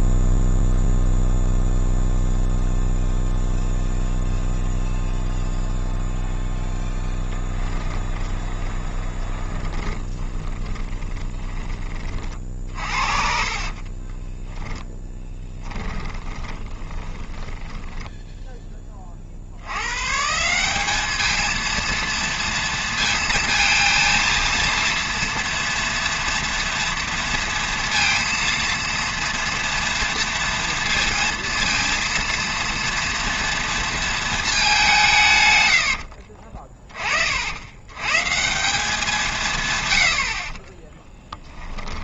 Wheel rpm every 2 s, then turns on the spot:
0, 0, 0, 10, 20, 20, 50, 10, 20, 20, 200, 230, 230, 230, 230, 230, 240, 190, 30, 180, 20.
8-18 40-42